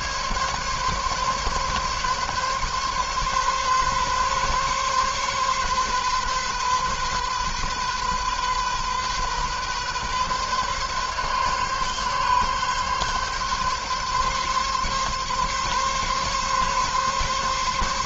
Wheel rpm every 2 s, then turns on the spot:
140, 140, 140, 130, 130, 130, 140, 140, 140.
none